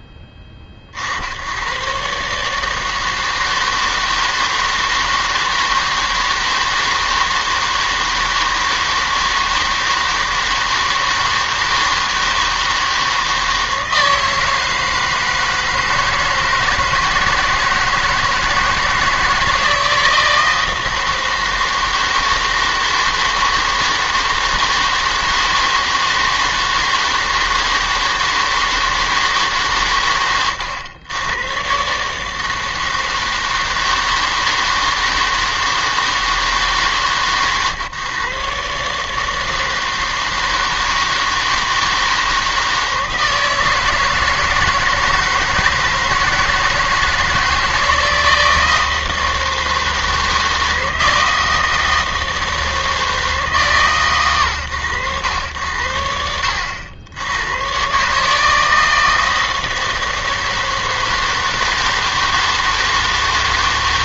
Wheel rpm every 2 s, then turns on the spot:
50, 160, 160, 160, 160, 160, 160, 160, 160, 160, 160, 160, 160, 160, 160, 110, 160, 160, 130, 150, 160, 160, 160, 160, 160, 160, 160, 100, 90, 160, 160, 160.
none